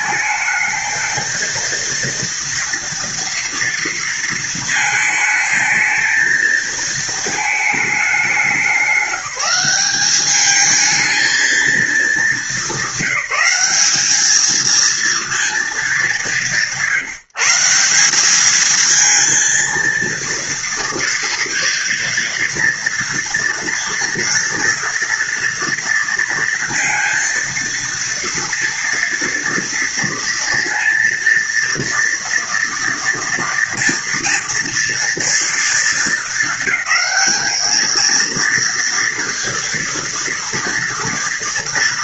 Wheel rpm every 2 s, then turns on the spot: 220, 240, 230, 230, 200, 210, 210, 220, 180, 210, 230, 230, 230, 230, 230, 230, 230, 230, 220, 230, 230.
none